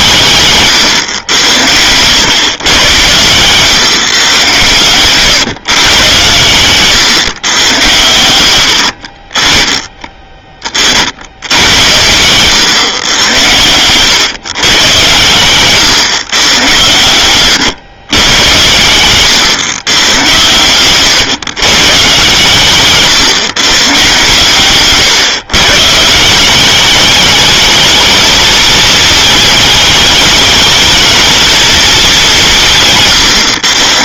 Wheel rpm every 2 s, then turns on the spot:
130, 130, 120, 130, 40, 50, 110, 110, 110, 120, 120, 130, 130, 200, 220, 220, 150.
18-20 32-34